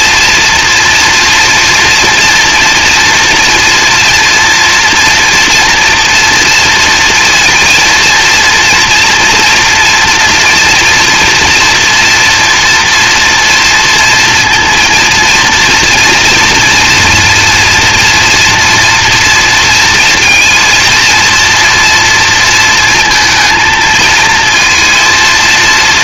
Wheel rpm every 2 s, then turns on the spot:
230, 230, 230, 230, 230, 230, 230, 230, 230, 240, 230, 230, 230.
none